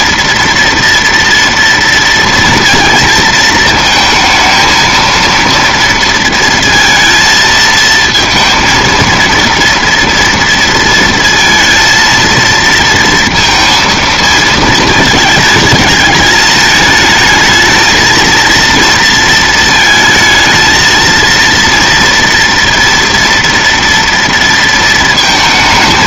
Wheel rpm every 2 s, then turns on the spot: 230, 230, 220, 230, 230, 230, 230, 220, 220, 230, 220, 230, 230.
none